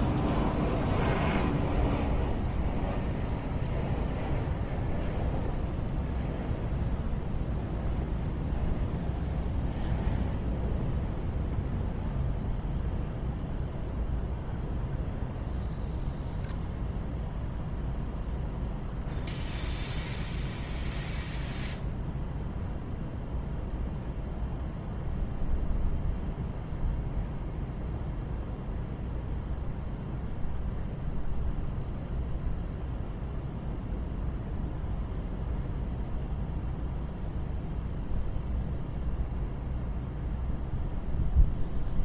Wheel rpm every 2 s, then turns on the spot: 10, 0, 0, 0, 0, 0, 0, 0, 0, 0, 0, 0, 0, 0, 0, 0, 0, 0, 0, 0, 0.
none